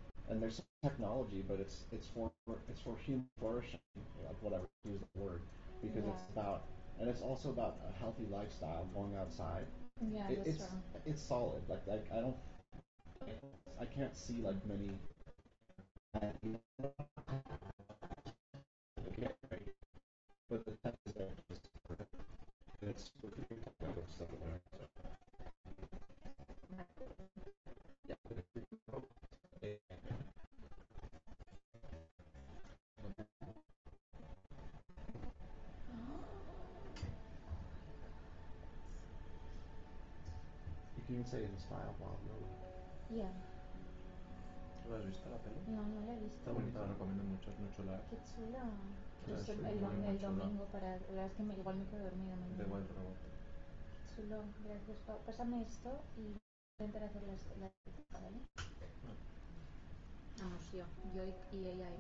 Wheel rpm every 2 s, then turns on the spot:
0, 0, 0, 0, 0, 0, 0, 0, 0, 0, 0, 0, 0, 0, 0, 0, 0, 0, 0, 0, 0, 0, 0, 0, 0, 0, 0, 0, 0, 0, 0.
none